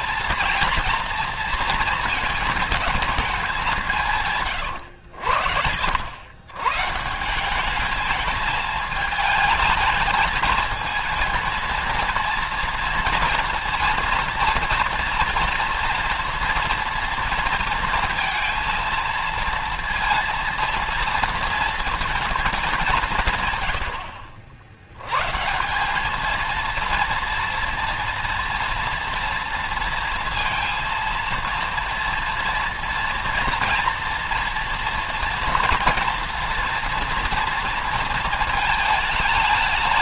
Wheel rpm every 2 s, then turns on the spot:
230, 220, 100, 140, 220, 230, 230, 230, 230, 230, 230, 190, 120, 230, 230, 230, 230, 230, 230, 220.
none